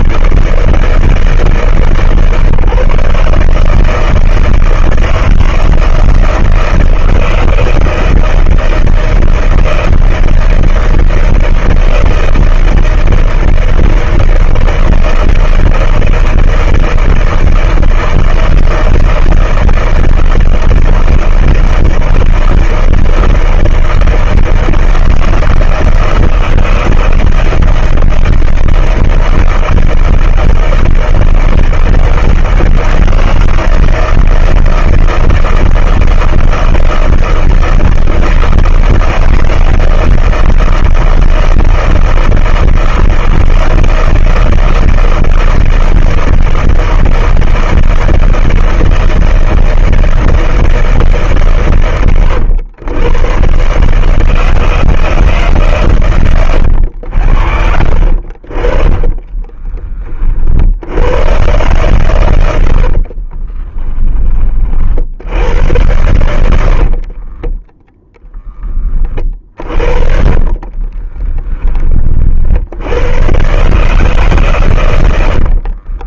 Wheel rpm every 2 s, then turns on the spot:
80, 160, 160, 160, 160, 160, 160, 160, 160, 160, 160, 160, 160, 160, 160, 160, 160, 160, 160, 160, 160, 160, 160, 160, 160, 160, 150, 120, 150, 70, 20, 110, 50, 80, 40, 40, 20, 110.
60-62 64-66 68-74